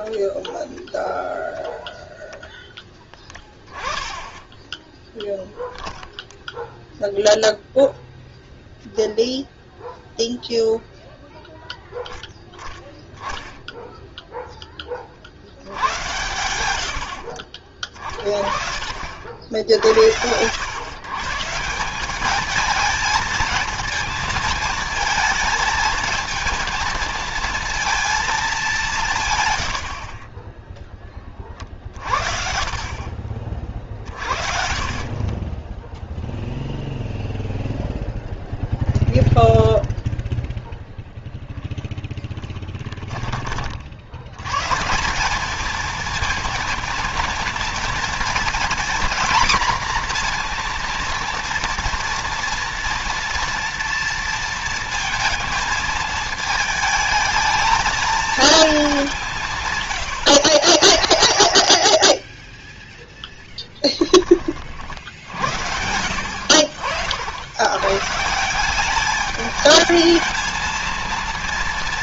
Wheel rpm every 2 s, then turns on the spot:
0, 0, 20, 0, 0, 0, 0, 10, 110, 30, 80, 210, 220, 230, 210, 20, 40, 50, 0, 0, 0, 10, 110, 230, 240, 240, 230, 230, 220, 220, 90, 10, 40, 70, 170, 220.
42-44